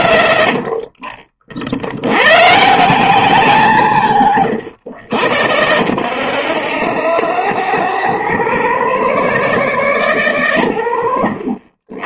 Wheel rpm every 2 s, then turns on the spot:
40, 150, 90, 0, 0, 10.
0-2 10-12